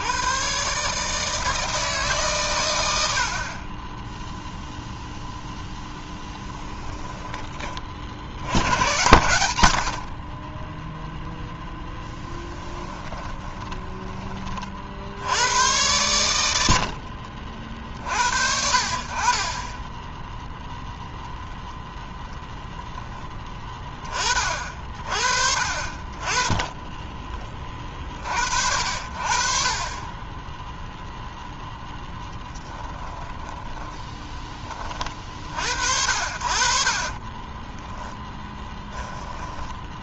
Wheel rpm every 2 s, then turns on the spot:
150, 80, 0, 20, 80, 0, 10, 60, 60, 50, 0, 0, 50, 20, 60, 0, 10, 30, 40, 10.
6-8 12-14 16-18 26-28 32-34 36-40